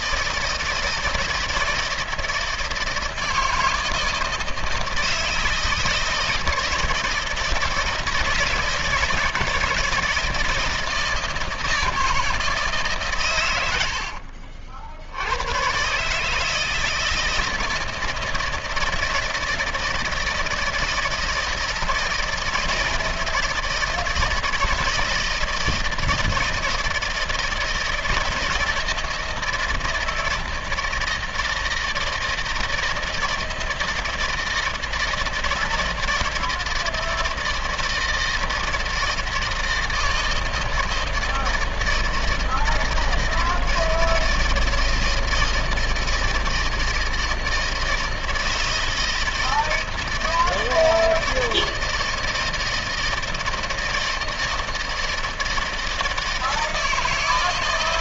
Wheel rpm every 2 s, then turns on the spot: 160, 160, 160, 160, 160, 160, 160, 60, 150, 160, 160, 160, 160, 160, 160, 160, 160, 160, 160, 160, 160, 160, 160, 160, 160, 160, 160, 160, 160.
none